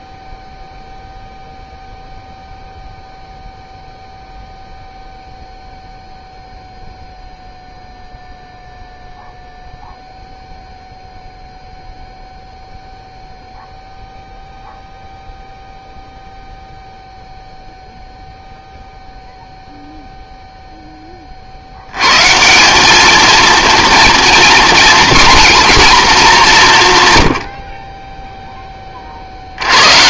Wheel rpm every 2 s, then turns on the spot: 0, 0, 0, 0, 0, 0, 0, 0, 0, 0, 0, 200, 240, 160, 10.
none